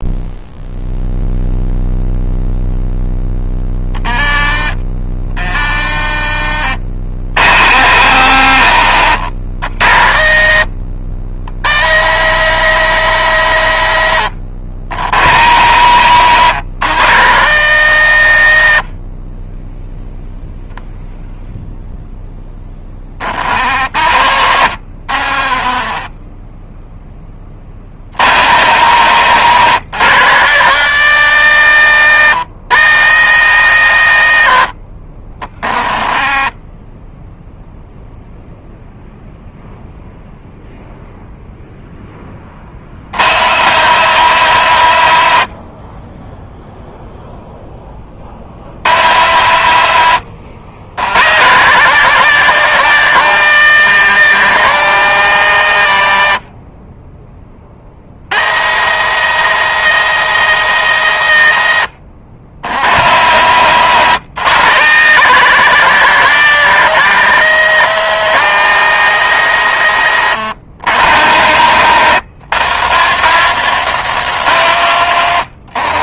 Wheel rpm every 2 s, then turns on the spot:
0, 10, 50, 90, 120, 110, 170, 110, 150, 40, 10, 60, 60, 20, 150, 170, 160, 60, 10, 0, 0, 100, 90, 0, 100, 110, 180, 140, 20, 170, 140, 130, 160, 180, 170, 130, 170, 120.
2-6 24-26 34-36